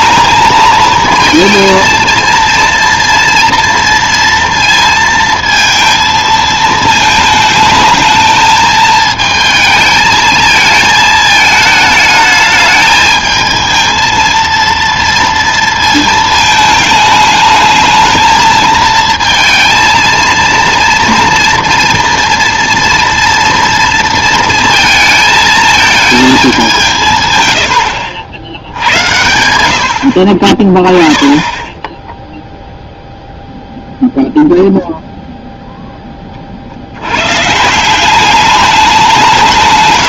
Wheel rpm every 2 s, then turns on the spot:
220, 230, 230, 220, 220, 220, 210, 230, 220, 220, 230, 230, 230, 190, 80, 20, 0, 0, 50, 200.
none